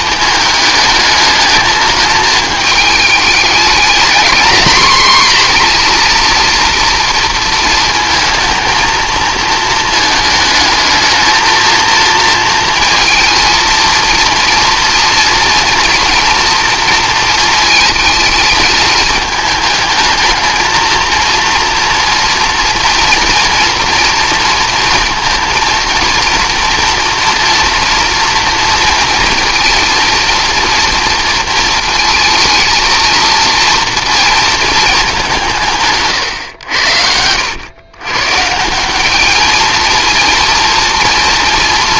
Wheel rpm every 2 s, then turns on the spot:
210, 220, 230, 230, 230, 220, 230, 230, 230, 220, 220, 230, 230, 230, 240, 230, 230, 220, 100, 160, 230.
none